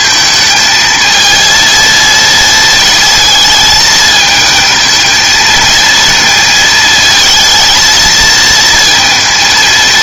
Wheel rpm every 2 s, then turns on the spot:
220, 220, 220, 220, 230.
none